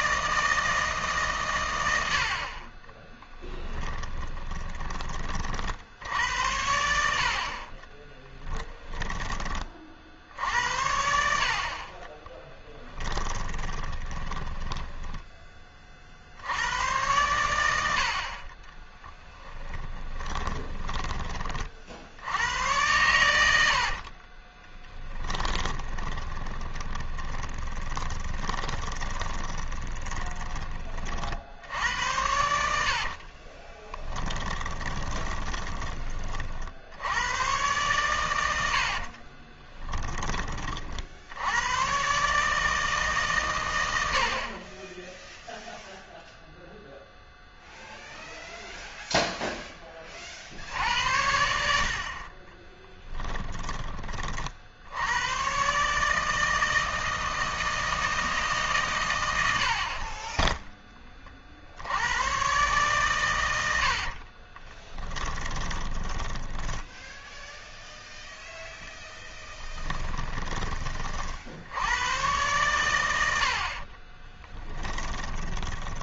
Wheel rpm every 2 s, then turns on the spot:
160, 20, 20, 80, 10, 70, 30, 10, 100, 10, 20, 100, 20, 20, 20, 20, 80, 10, 60, 60, 40, 150, 30, 0, 0, 80, 20, 70, 160, 130, 10, 130, 20, 0, 0, 20, 110, 10.
4-6 8-10 12-16 18-22 24-30 32-36 38-40 52-54 64-66 74-76